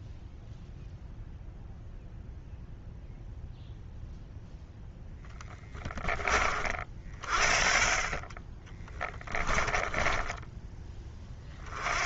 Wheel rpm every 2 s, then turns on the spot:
0, 0, 0, 40, 20, 20.
8-10